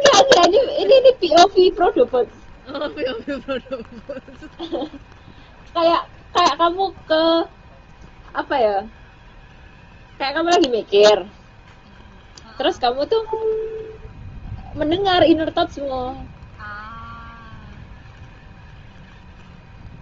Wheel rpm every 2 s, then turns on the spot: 0, 0, 0, 0, 0, 0, 0, 0, 0, 0.
none